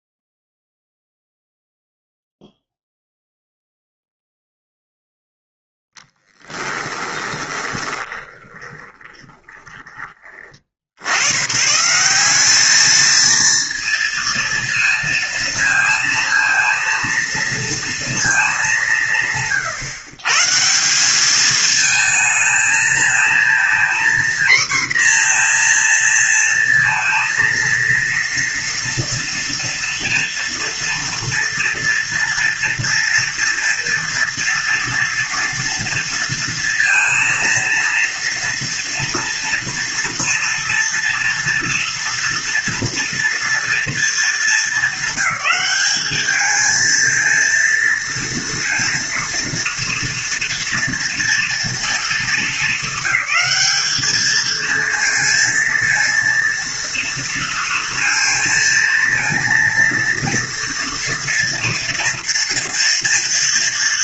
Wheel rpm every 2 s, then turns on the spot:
0, 0, 0, 10, 20, 50, 210, 230, 230, 200, 170, 220, 250, 230, 230, 230, 230, 230, 230, 230, 230, 230, 200, 220, 230, 230, 220, 230, 230, 230, 230, 230.
6-10